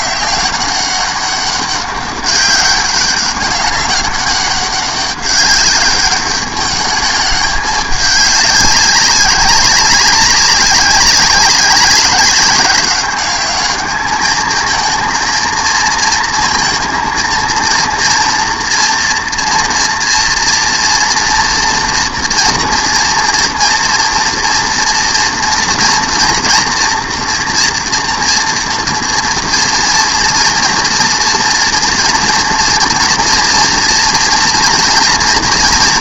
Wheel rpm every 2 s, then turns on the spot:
200, 200, 200, 210, 200, 190, 200, 220, 230, 230, 230, 230, 230, 230, 230, 230, 230, 230.
none